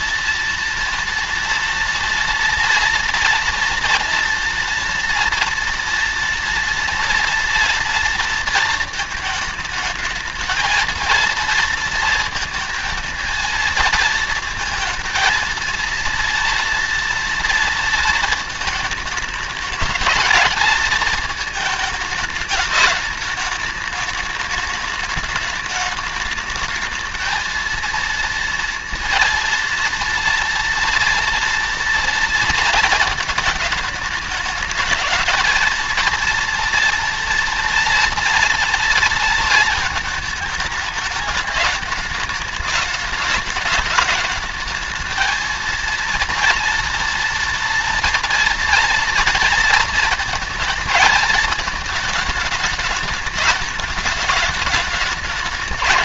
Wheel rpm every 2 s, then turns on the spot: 230, 230, 240, 230, 230, 220, 230, 230, 230, 220, 220, 210, 210, 210, 230, 230, 230, 220, 230, 230, 210, 210, 220, 230, 230, 220, 220, 210.
none